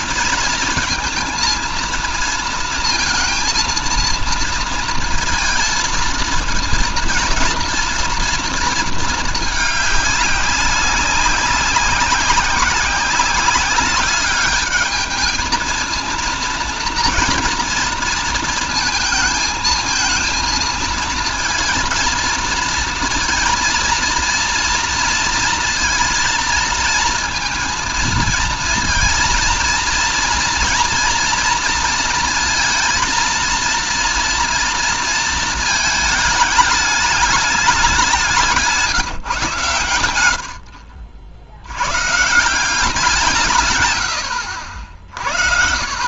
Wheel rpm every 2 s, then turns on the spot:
230, 230, 230, 230, 230, 200, 190, 210, 230, 230, 230, 230, 230, 230, 230, 230, 230, 230, 210, 150, 70, 180, 70.
none